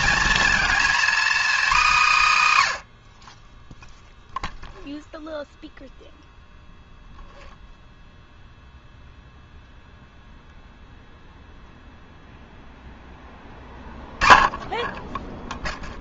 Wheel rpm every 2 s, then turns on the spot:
240, 120, 0, 0, 0, 0, 0, 10.
none